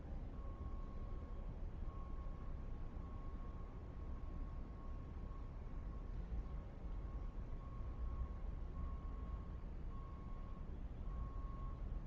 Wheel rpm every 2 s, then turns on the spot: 0, 0, 0, 0, 0, 0.
none